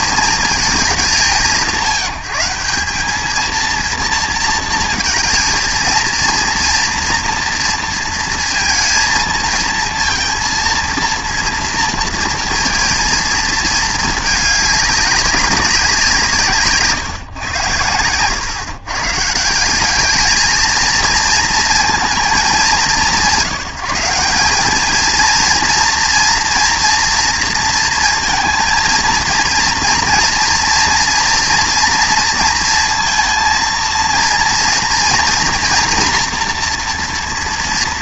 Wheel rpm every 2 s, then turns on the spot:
190, 180, 220, 230, 230, 230, 230, 210, 150, 130, 220, 170, 210, 230, 230, 230, 230, 230, 240.
none